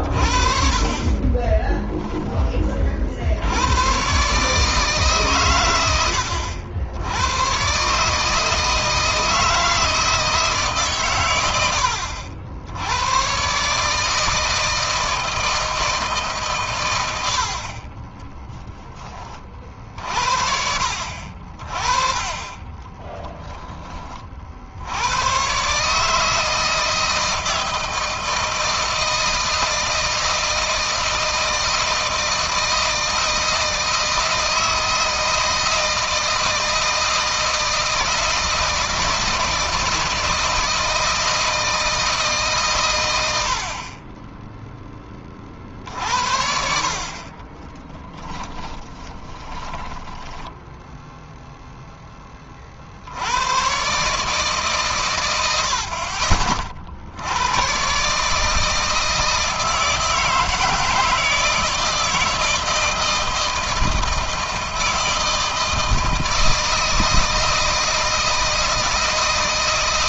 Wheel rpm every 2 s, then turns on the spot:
40, 50, 140, 90, 160, 140, 90, 160, 110, 20, 60, 20, 90, 160, 160, 160, 170, 160, 160, 160, 160, 110, 20, 50, 20, 0, 70, 130, 60, 160, 160, 160, 160, 160, 160.
0-2 22-24 46-50